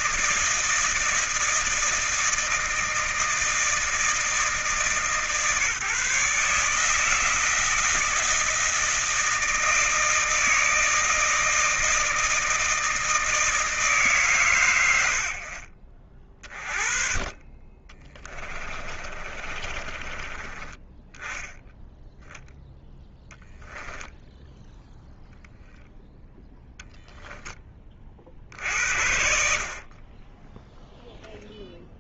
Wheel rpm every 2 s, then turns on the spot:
160, 160, 160, 160, 160, 160, 160, 110, 30, 20, 20, 0, 0, 0, 50, 10.
18-20